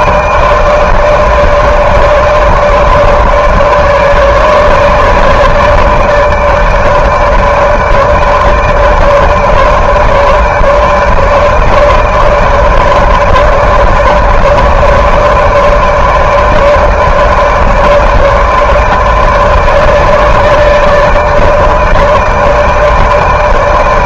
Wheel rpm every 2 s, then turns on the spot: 160, 150, 150, 150, 150, 150, 150, 150, 150, 150, 150, 150.
none